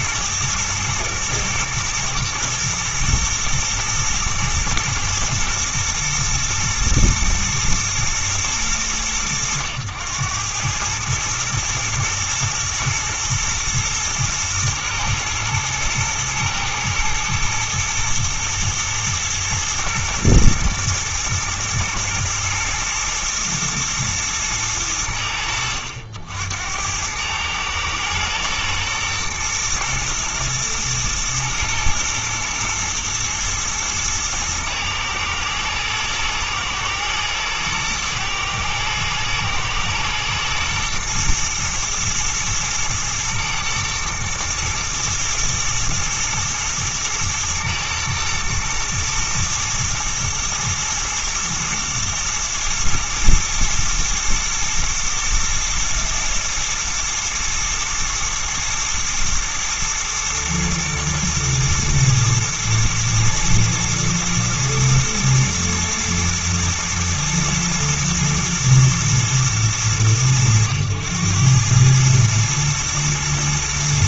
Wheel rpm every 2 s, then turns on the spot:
110, 120, 110, 120, 110, 100, 120, 110, 110, 120, 120, 120, 90, 80, 110, 110, 110, 110, 120, 120, 110, 120, 110, 110, 110, 110, 110, 110, 120, 110, 120, 120, 120, 120, 120, 100, 110.
none